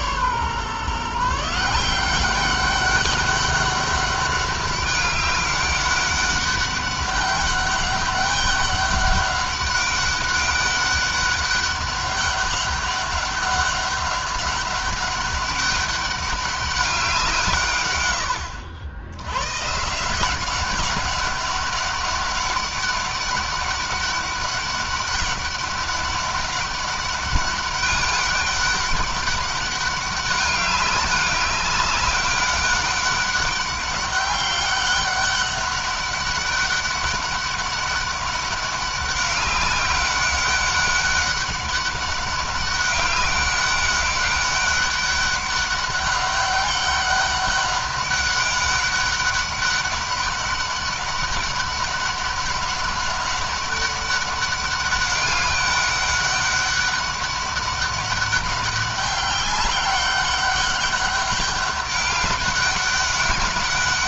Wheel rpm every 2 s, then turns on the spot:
140, 200, 200, 200, 200, 200, 200, 200, 190, 90, 190, 200, 200, 200, 200, 200, 200, 200, 200, 200, 200, 200, 200, 200, 200, 200, 200, 200, 200, 190, 200, 200.
none